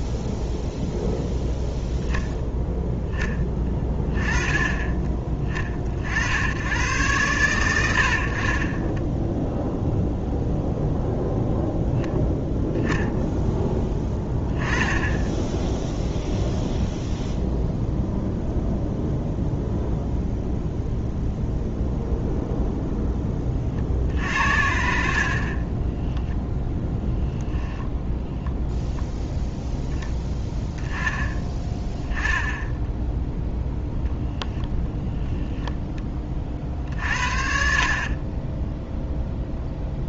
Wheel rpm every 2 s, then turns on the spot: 0, 10, 20, 100, 30, 0, 0, 10, 0, 0, 0, 0, 60, 0, 0, 10, 0, 0, 40, 10.
none